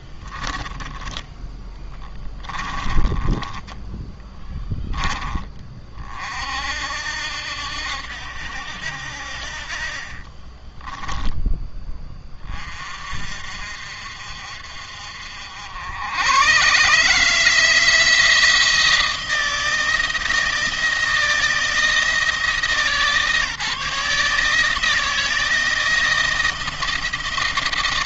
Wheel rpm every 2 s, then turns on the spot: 10, 20, 10, 60, 70, 20, 30, 50, 130, 160, 160, 160, 160, 160.
2-4 10-12